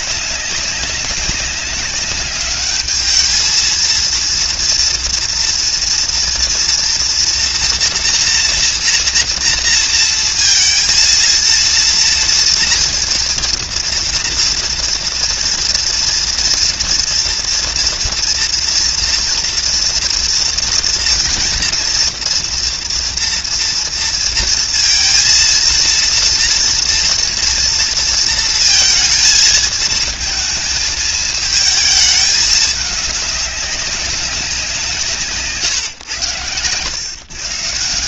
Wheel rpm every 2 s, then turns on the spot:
190, 210, 230, 230, 240, 230, 240, 230, 230, 230, 230, 230, 230, 230, 230, 230, 210, 180, 120.
none